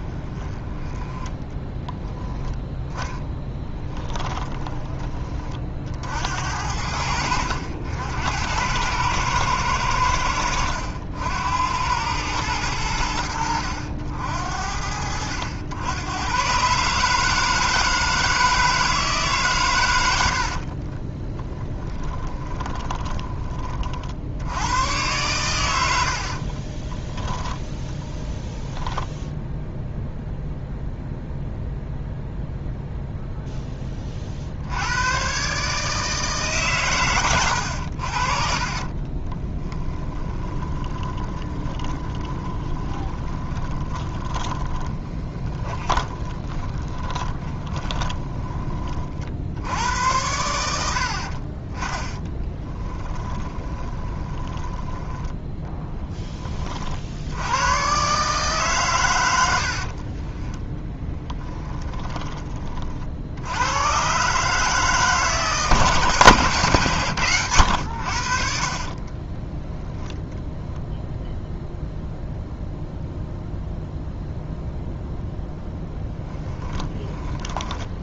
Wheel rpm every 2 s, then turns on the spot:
20, 10, 20, 70, 90, 80, 90, 70, 130, 160, 50, 10, 90, 30, 10, 0, 0, 70, 140, 40, 20, 20, 20, 20, 40, 90, 10, 20, 40, 140, 10, 30, 150, 130, 40, 0, 0, 0, 10.
0-2 4-6 20-24 26-28 38-48 50-56 60-62 68-70 76-78